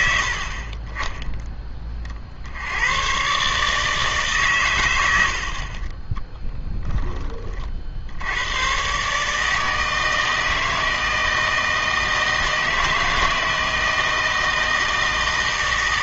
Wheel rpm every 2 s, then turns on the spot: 30, 80, 120, 0, 100, 160, 160, 160.
none